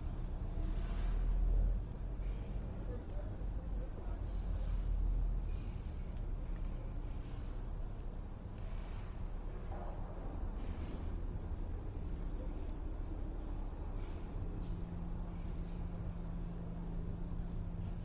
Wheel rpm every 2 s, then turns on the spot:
0, 0, 0, 0, 0, 0, 0, 0, 0.
none